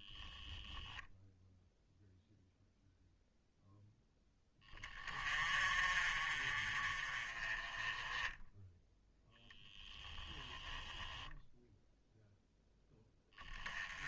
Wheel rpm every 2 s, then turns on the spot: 0, 0, 30, 20, 10, 0, 10.
none